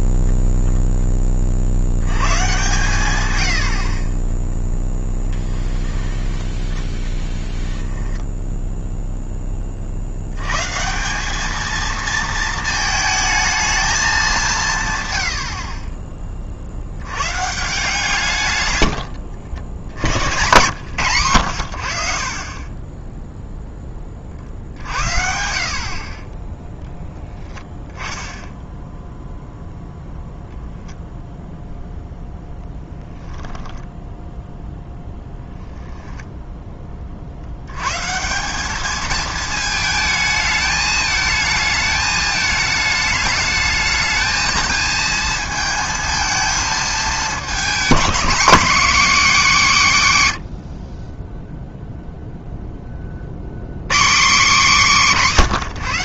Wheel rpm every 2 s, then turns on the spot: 0, 110, 20, 10, 0, 110, 220, 180, 40, 130, 130, 30, 50, 10, 0, 0, 0, 10, 10, 180, 220, 210, 220, 220, 230, 100, 10, 220.
4-6